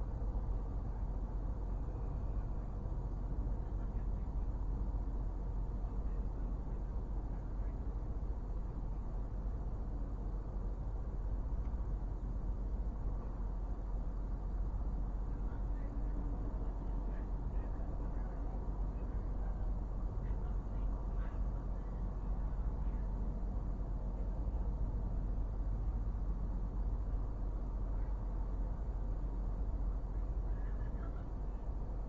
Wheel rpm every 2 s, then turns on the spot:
0, 0, 0, 0, 0, 0, 0, 0, 0, 0, 0, 0, 0, 0, 0, 0.
none